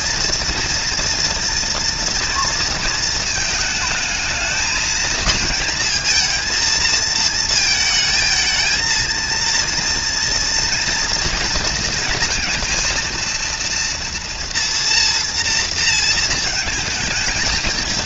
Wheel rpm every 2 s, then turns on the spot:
230, 230, 220, 230, 220, 230, 230, 230, 230.
none